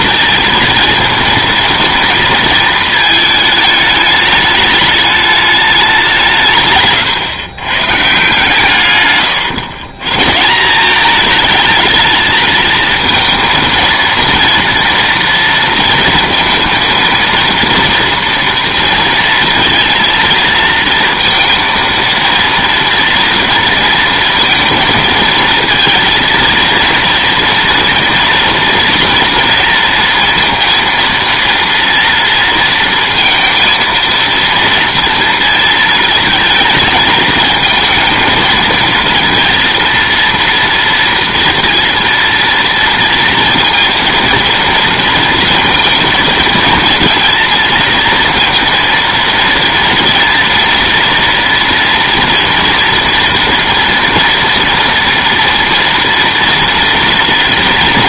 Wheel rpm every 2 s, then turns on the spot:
230, 220, 210, 140, 140, 170, 220, 230, 220, 230, 230, 230, 230, 230, 240, 230, 230, 230, 230, 230, 230, 230, 230, 230, 230, 230, 240, 240, 230.
none